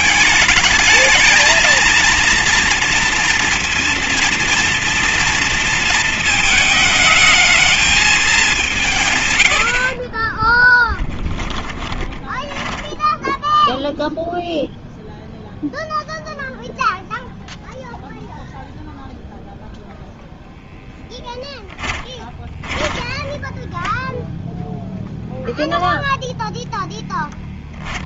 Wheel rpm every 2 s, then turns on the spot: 210, 230, 230, 220, 200, 20, 10, 0, 0, 0, 0, 10, 0, 0.
10-14 22-24